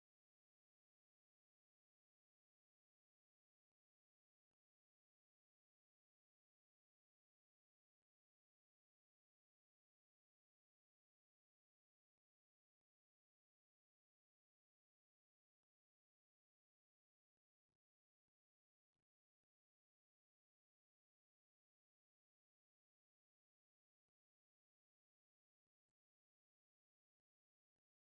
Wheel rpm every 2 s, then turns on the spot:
0, 0, 0, 0, 0, 0, 0, 0, 0, 0, 0, 0, 0, 0.
none